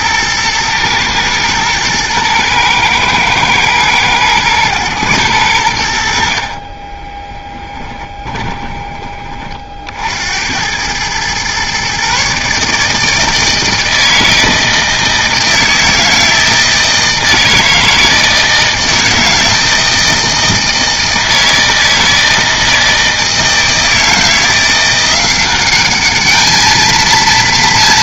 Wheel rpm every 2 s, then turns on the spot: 120, 120, 110, 30, 20, 100, 150, 160, 160, 160, 160, 160, 170, 220.
6-8